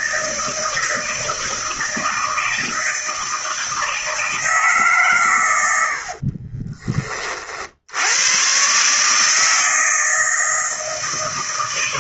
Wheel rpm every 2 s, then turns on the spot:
160, 160, 160, 30, 120, 160.
6-8